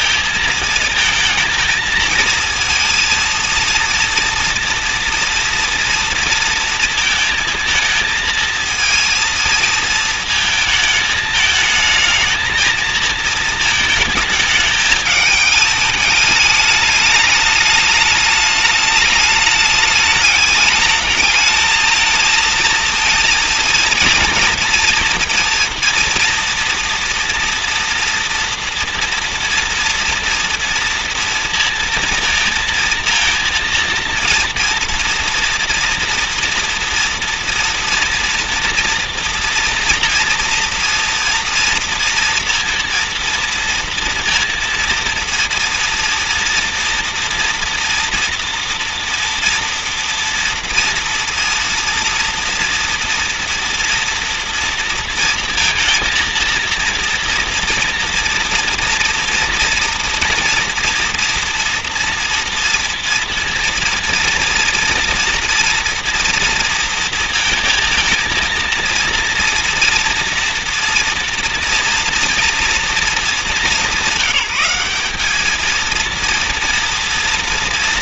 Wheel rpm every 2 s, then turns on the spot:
220, 230, 240, 230, 220, 230, 220, 220, 210, 210, 210, 220, 230, 240, 240, 230, 230, 230, 230, 230, 230, 230, 230, 230, 240, 230, 230, 230, 230, 230, 230, 230, 230, 230, 230, 230, 230, 190, 230.
none